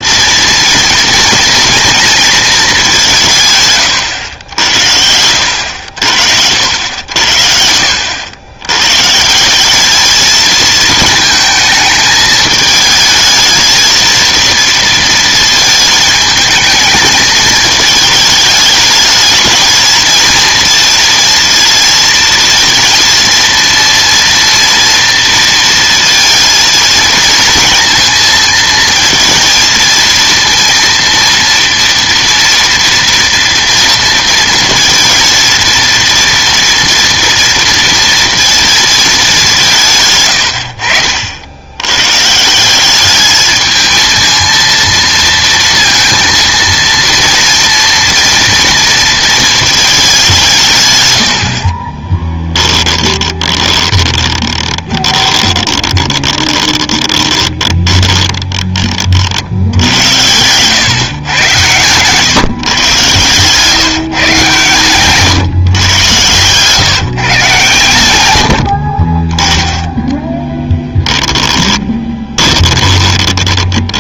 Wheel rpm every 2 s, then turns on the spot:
230, 210, 80, 80, 110, 230, 220, 230, 220, 220, 230, 230, 230, 220, 230, 230, 230, 230, 240, 230, 70, 180, 230, 230, 230, 150, 20, 20, 20, 30, 120, 140, 120, 140, 60, 20, 20.
52-58 70-74